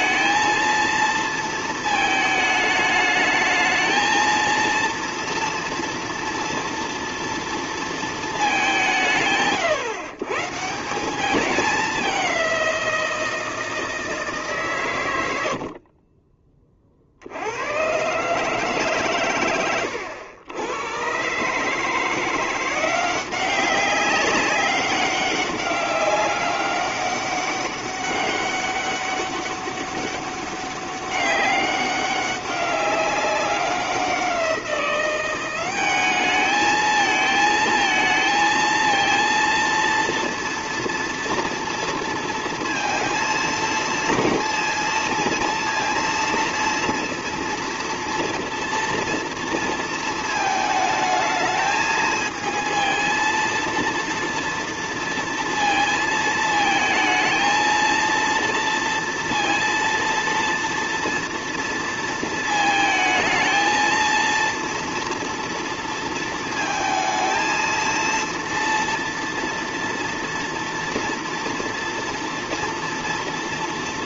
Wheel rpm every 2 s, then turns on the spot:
230, 210, 230, 230, 190, 150, 180, 140, 30, 140, 90, 180, 200, 200, 200, 200, 190, 180, 220, 230, 230, 230, 230, 230, 230, 220, 220, 230, 220, 230, 230, 220, 230, 220, 230, 230, 230.
none